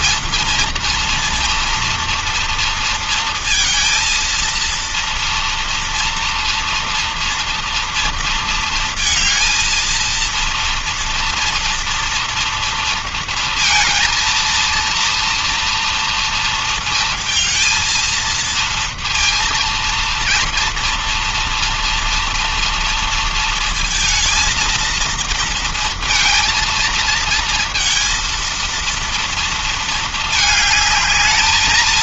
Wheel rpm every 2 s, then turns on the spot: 230, 230, 230, 230, 230, 230, 230, 230, 230, 230, 230, 230, 230, 230, 230, 220.
none